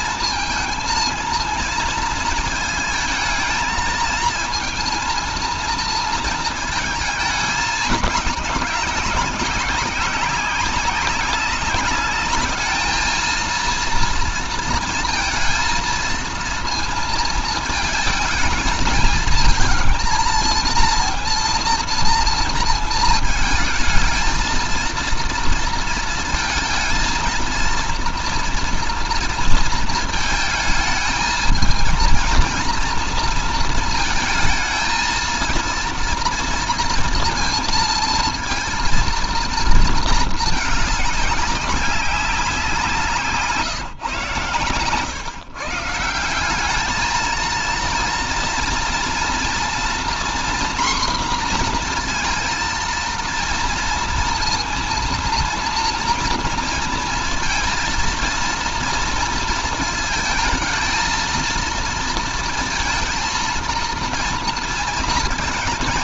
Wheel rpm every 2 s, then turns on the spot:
230, 220, 230, 220, 190, 200, 210, 230, 230, 220, 230, 230, 230, 230, 240, 220, 230, 220, 230, 230, 220, 190, 140, 190, 230, 240, 230, 230, 230, 230, 220, 230, 230.
none